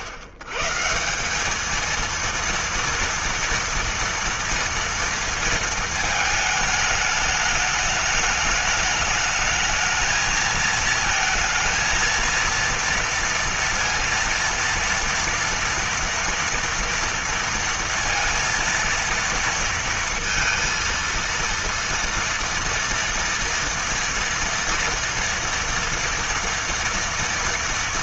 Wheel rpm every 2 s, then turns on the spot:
130, 230, 230, 220, 210, 220, 230, 230, 230, 230, 230, 230, 230, 230.
none